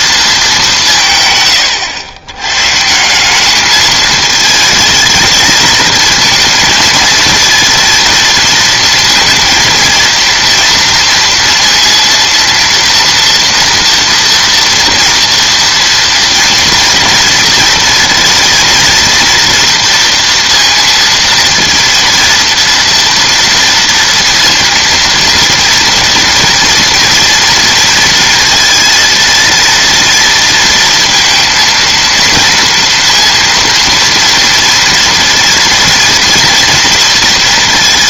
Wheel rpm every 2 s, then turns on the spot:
180, 160, 220, 230, 230, 230, 230, 230, 240, 230, 230, 230, 230, 230, 230, 230, 230, 240, 230.
none